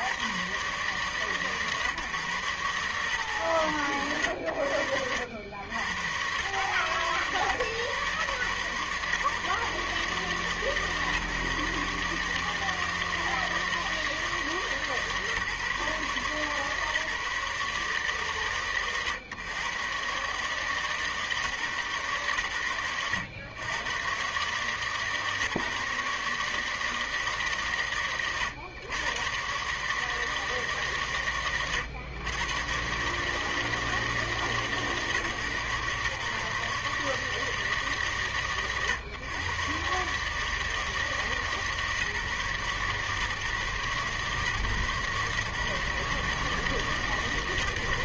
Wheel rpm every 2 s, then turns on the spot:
60, 140, 90, 100, 120, 140, 150, 160, 140, 130, 130, 130, 120, 150, 110, 150, 110, 160, 140, 130, 140, 150, 130, 140.
none